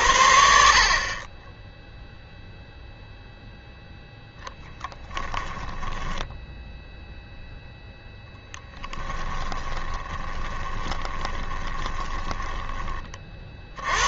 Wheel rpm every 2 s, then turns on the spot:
60, 0, 10, 0, 10, 20, 10.
4-6 8-12